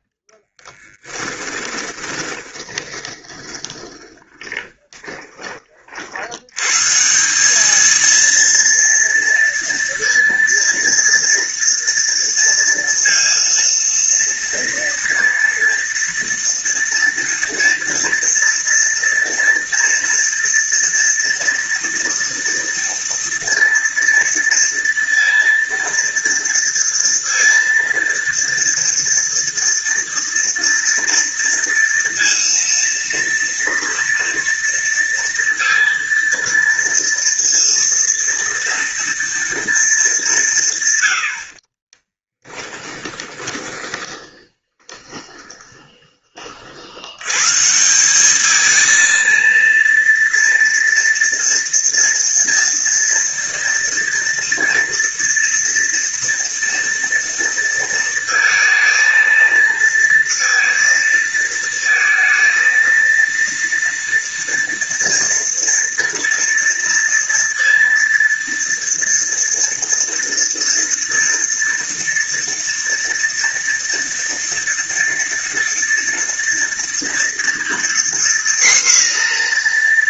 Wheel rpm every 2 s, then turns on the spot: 20, 20, 20, 140, 230, 230, 230, 230, 230, 230, 230, 230, 230, 230, 230, 230, 230, 230, 230, 230, 120, 20, 20, 80, 220, 230, 230, 230, 230, 230, 230, 230, 230, 230, 230, 230, 230, 230, 230, 240.
0-6 42-46